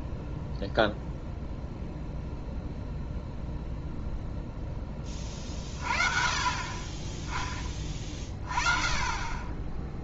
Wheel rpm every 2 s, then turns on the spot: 0, 0, 10, 30, 20.
none